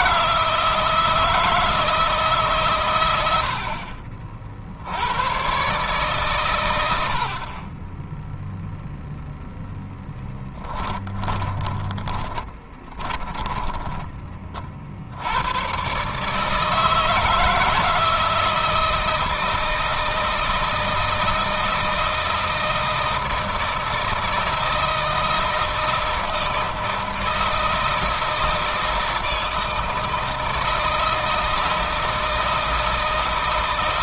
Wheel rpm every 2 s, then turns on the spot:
160, 140, 70, 110, 0, 10, 20, 50, 150, 160, 160, 160, 160, 160, 160, 160, 160.
10-14